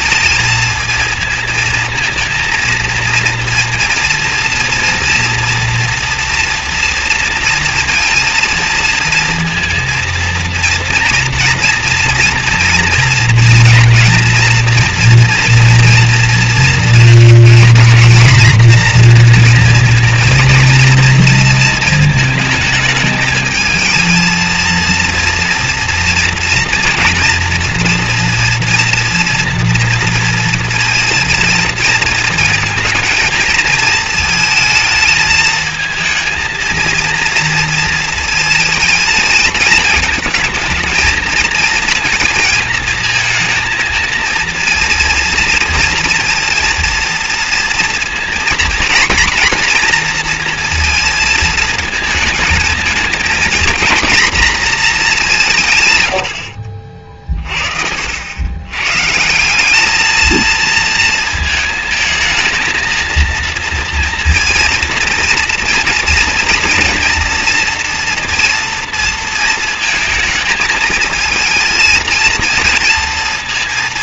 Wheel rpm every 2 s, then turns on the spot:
230, 230, 240, 230, 230, 230, 240, 230, 240, 240, 230, 220, 230, 230, 230, 230, 230, 220, 230, 230, 220, 230, 230, 230, 230, 230, 220, 240, 70, 90, 220, 220, 230, 230, 230, 220, 230.
56-58